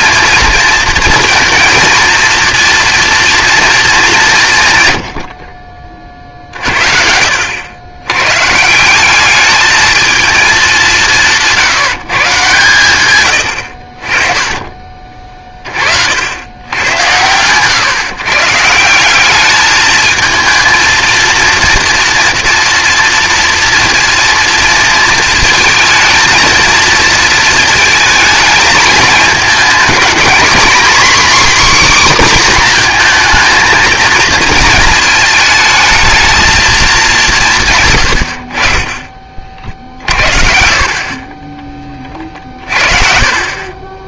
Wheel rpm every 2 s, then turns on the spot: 230, 230, 140, 70, 180, 190, 110, 30, 100, 170, 230, 230, 230, 230, 220, 260, 240, 220, 210, 40, 40, 40.
42-44